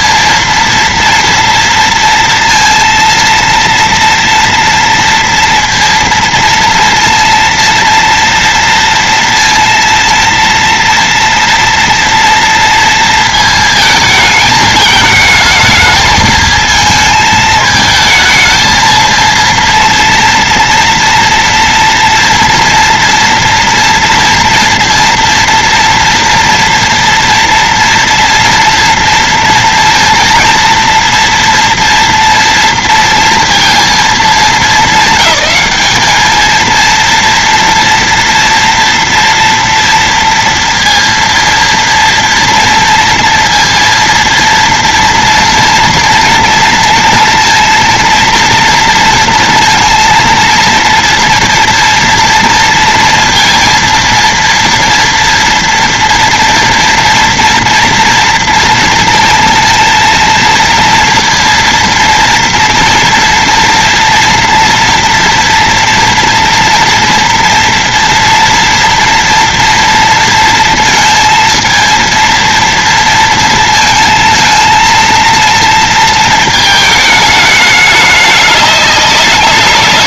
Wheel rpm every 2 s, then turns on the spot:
230, 230, 230, 230, 230, 230, 230, 220, 220, 220, 230, 230, 230, 230, 230, 230, 230, 210, 220, 230, 230, 230, 230, 230, 230, 230, 230, 230, 230, 230, 230, 230, 230, 230, 230, 230, 230, 220, 220, 200.
none